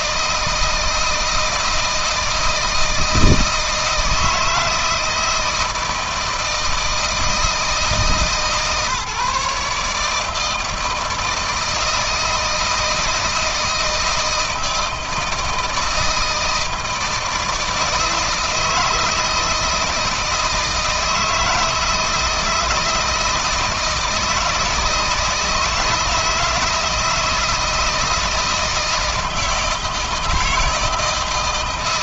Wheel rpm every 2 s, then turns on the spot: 160, 160, 160, 160, 140, 160, 160, 160, 160, 160, 160, 160, 160, 160, 160, 160.
none